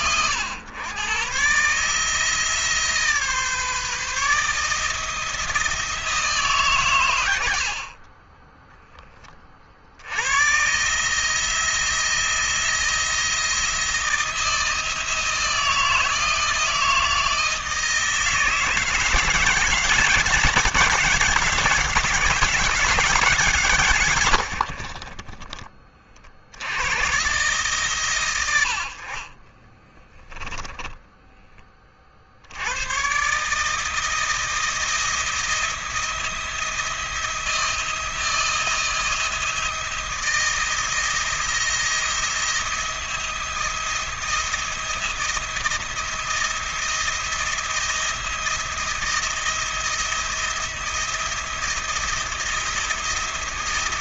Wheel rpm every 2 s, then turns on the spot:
110, 150, 160, 140, 10, 130, 160, 160, 160, 160, 180, 190, 70, 70, 80, 10, 90, 170, 170, 160, 170, 170, 170, 170, 170, 170, 170.
8-10 24-26 30-32